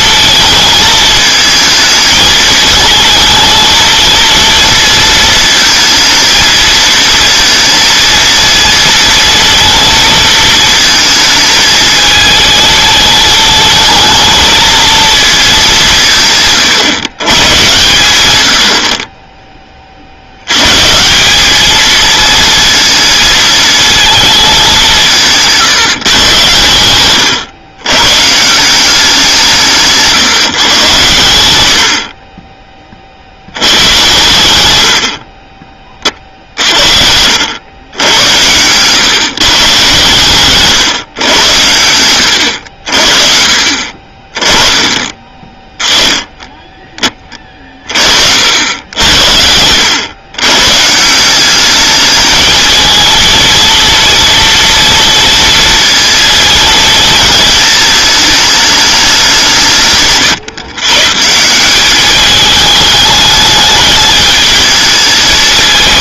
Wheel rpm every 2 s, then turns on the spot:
220, 220, 230, 230, 230, 220, 220, 230, 150, 60, 130, 230, 190, 110, 180, 140, 20, 80, 60, 120, 130, 80, 20, 20, 80, 150, 220, 230, 230, 210, 140, 210, 220.
40-42